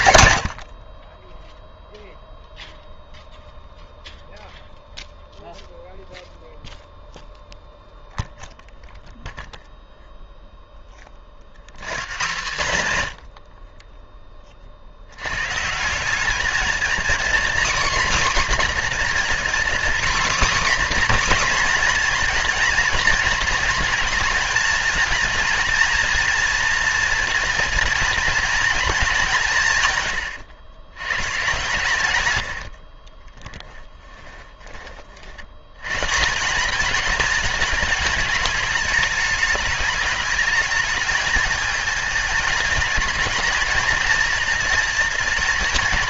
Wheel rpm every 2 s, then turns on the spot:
100, 0, 0, 0, 0, 0, 150, 50, 230, 250, 270, 230, 230, 240, 230, 100, 70, 20, 200, 220, 210, 210, 220.
32-34